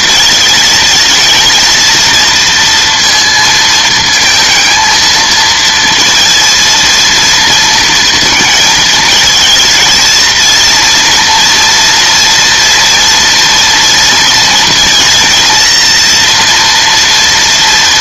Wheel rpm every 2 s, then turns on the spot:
230, 230, 230, 230, 220, 230, 230, 230, 230.
none